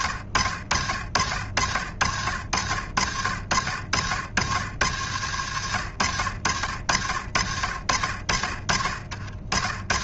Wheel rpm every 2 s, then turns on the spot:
70, 80, 90, 70, 50.
none